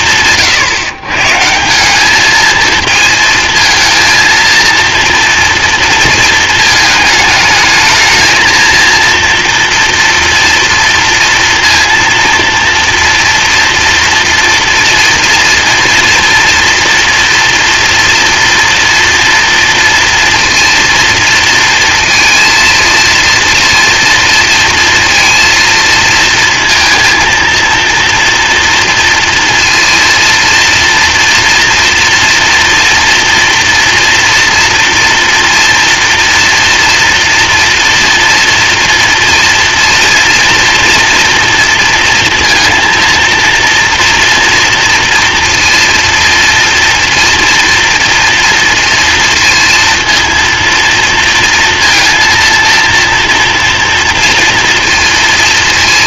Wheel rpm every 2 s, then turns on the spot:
140, 230, 230, 220, 230, 230, 230, 240, 240, 230, 230, 230, 230, 230, 230, 230, 230, 240, 230, 230, 230, 230, 230, 230, 230, 230, 230, 230.
none